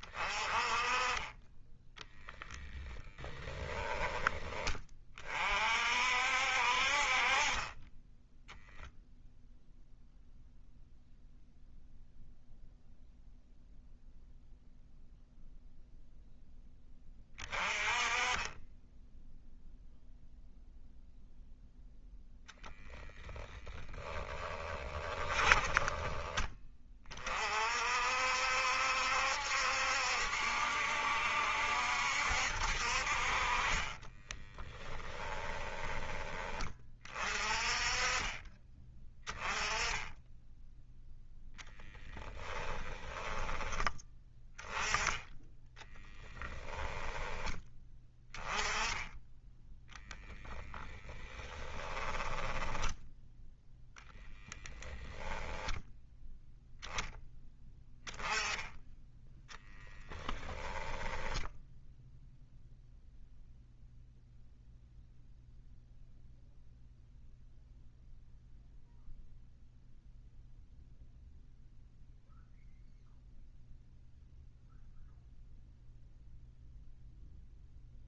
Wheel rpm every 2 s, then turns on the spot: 20, 10, 30, 40, 0, 0, 0, 0, 20, 10, 0, 0, 10, 40, 70, 70, 50, 10, 30, 10, 0, 10, 10, 10, 10, 20, 10, 10, 0, 10, 10, 0, 0, 0, 0, 0, 0, 0, 0.
2-4 24-26 34-36 42-44 50-52 60-62